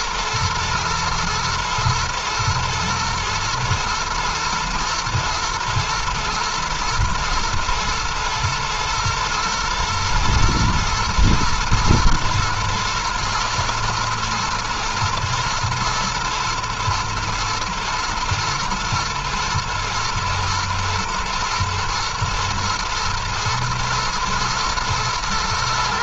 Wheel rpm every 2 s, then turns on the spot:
110, 110, 110, 110, 110, 110, 120, 110, 110, 110, 120, 120, 110.
none